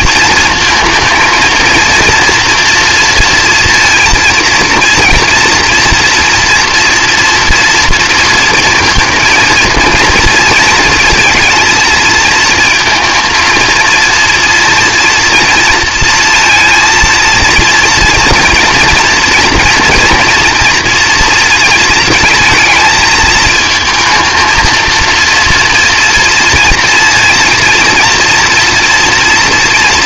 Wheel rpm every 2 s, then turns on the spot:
230, 230, 230, 230, 230, 230, 230, 230, 230, 230, 230, 220, 230, 230, 240.
none